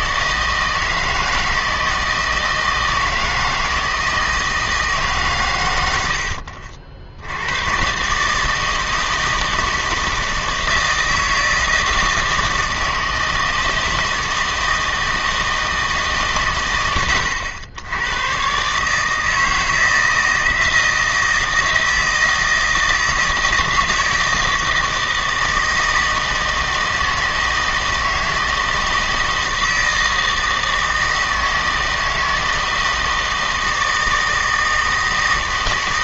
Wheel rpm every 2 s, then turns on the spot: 160, 160, 160, 70, 160, 160, 160, 160, 120, 130, 160, 160, 160, 160, 160, 160, 160, 160.
none